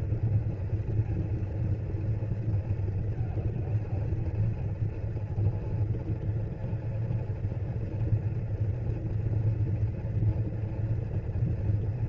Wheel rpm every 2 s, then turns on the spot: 230, 220, 230, 230, 240, 240.
none